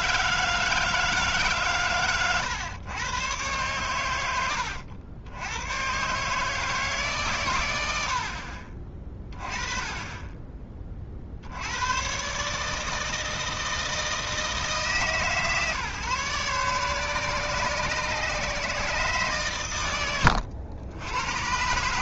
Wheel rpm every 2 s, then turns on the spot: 160, 110, 80, 150, 40, 30, 150, 160, 140, 140, 90.
none